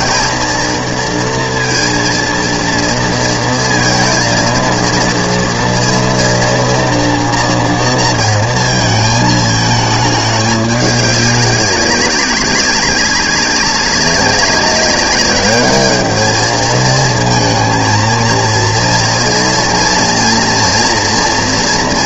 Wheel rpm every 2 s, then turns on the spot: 230, 230, 230, 230, 230, 210, 190, 200, 220, 230, 240.
none